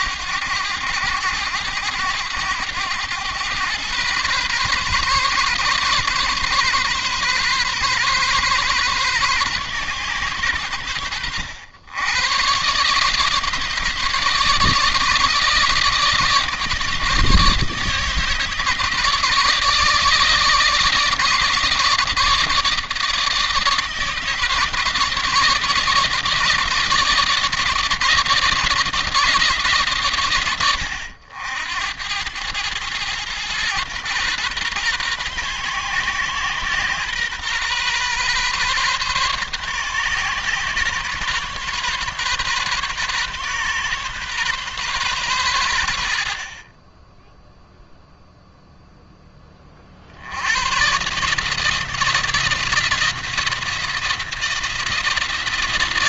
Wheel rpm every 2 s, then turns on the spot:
90, 100, 130, 130, 130, 100, 130, 150, 160, 160, 150, 160, 150, 160, 160, 90, 110, 120, 130, 130, 130, 130, 120, 20, 10, 130, 170, 170.
none